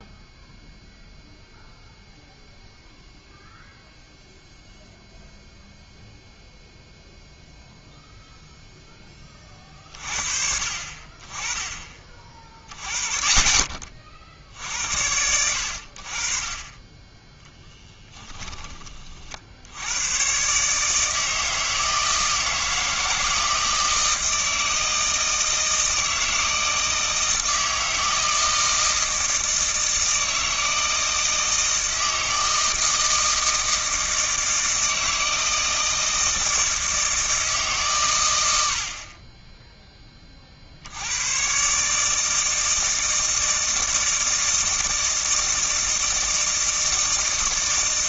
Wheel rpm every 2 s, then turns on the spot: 0, 0, 0, 0, 10, 40, 50, 70, 20, 30, 150, 160, 160, 160, 160, 160, 160, 160, 160, 70, 70, 160, 160, 160.
none